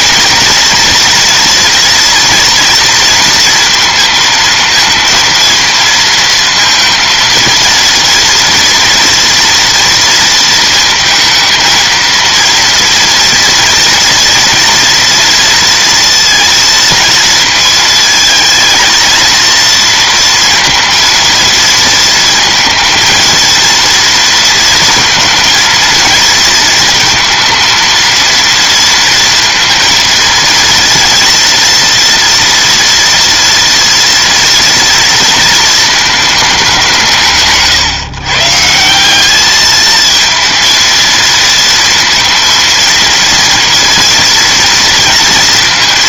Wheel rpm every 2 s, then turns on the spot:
230, 230, 230, 230, 230, 230, 230, 240, 230, 230, 230, 230, 230, 230, 230, 230, 230, 240, 190, 160, 230, 230, 230.
none